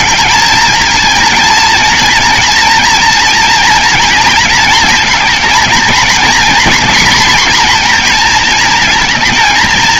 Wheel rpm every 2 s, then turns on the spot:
220, 230, 230, 240, 230.
none